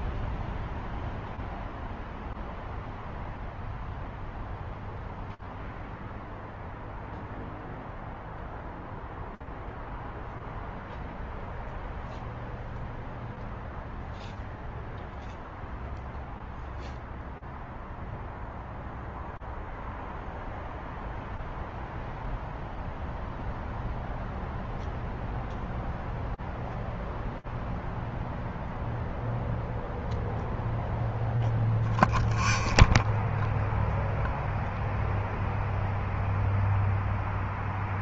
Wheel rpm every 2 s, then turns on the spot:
0, 0, 0, 0, 0, 0, 0, 0, 0, 0, 0, 0, 0, 0, 0, 0, 0, 0, 0.
none